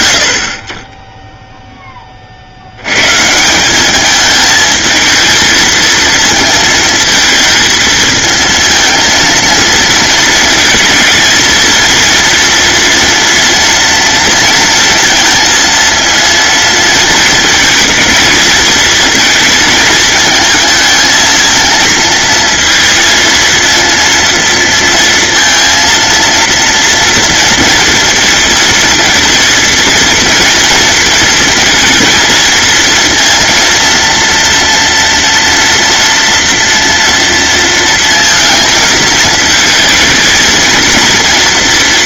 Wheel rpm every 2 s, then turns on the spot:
50, 110, 220, 220, 230, 230, 230, 230, 230, 230, 220, 230, 230, 230, 230, 230, 230, 230, 230, 220, 230.
none